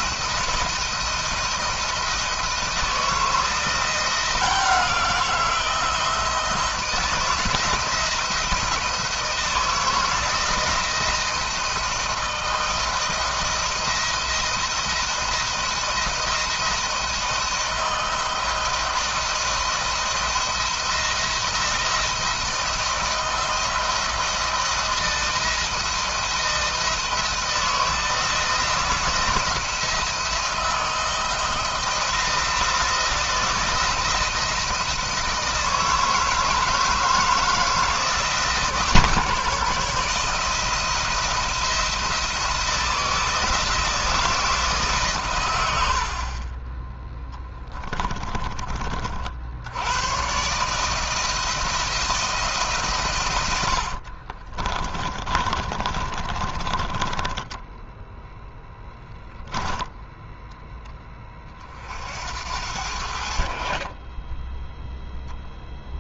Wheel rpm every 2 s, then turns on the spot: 170, 160, 170, 160, 170, 170, 160, 170, 170, 170, 170, 170, 160, 170, 170, 160, 170, 160, 160, 150, 160, 170, 150, 20, 40, 150, 130, 30, 20, 10, 10, 70, 0.
54-58